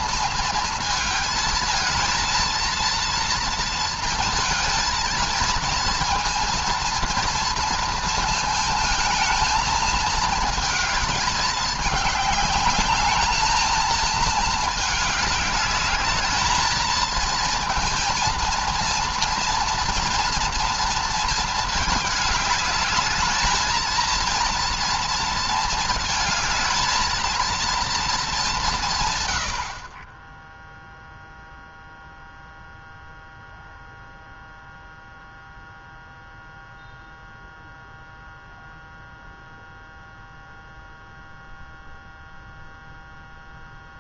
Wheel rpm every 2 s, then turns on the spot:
220, 230, 230, 230, 220, 230, 210, 220, 210, 230, 230, 210, 230, 220, 180, 0, 0, 0, 0, 0, 0, 0.
none